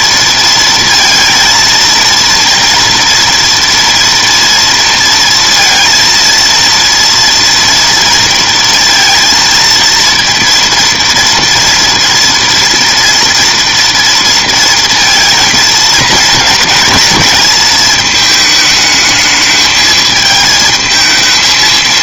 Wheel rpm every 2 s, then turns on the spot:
230, 230, 230, 230, 230, 230, 230, 230, 220, 220, 220.
none